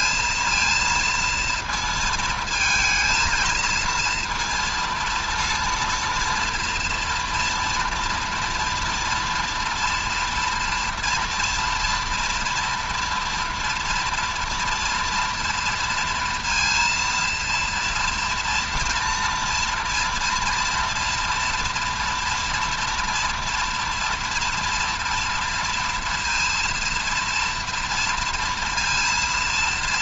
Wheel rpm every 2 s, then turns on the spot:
230, 220, 230, 230, 230, 230, 240, 230, 230, 230, 230, 230, 230, 230, 230.
none